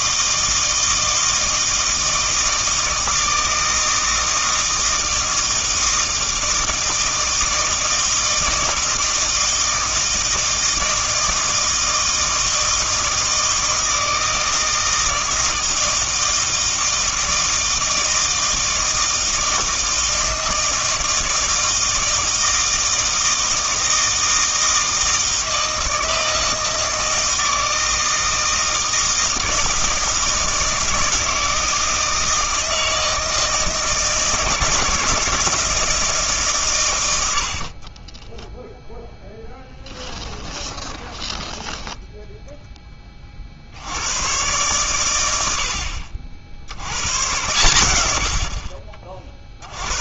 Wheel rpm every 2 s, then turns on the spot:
160, 160, 160, 160, 160, 160, 160, 160, 160, 160, 160, 160, 160, 160, 160, 160, 160, 160, 130, 0, 10, 10, 120, 80, 40.
40-42